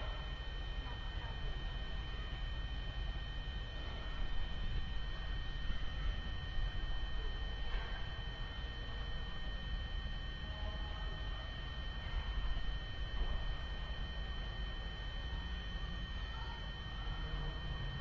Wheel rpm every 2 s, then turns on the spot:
0, 0, 0, 0, 0, 0, 0, 0, 0.
none